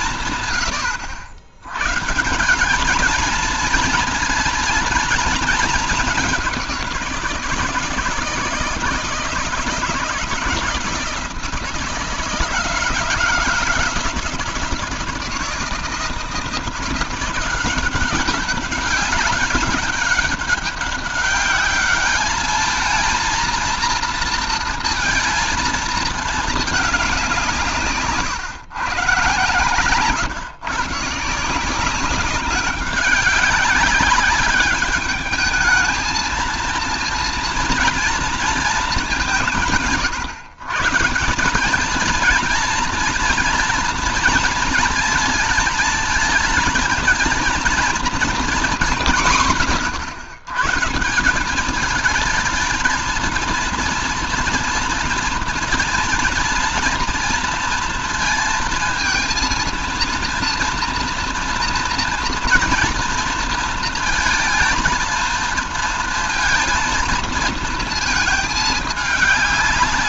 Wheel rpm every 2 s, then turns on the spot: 80, 220, 220, 160, 160, 160, 160, 160, 180, 190, 200, 230, 230, 190, 130, 150, 190, 210, 230, 190, 180, 230, 230, 230, 170, 170, 230, 230, 230, 230, 240, 230, 230, 230, 210.
none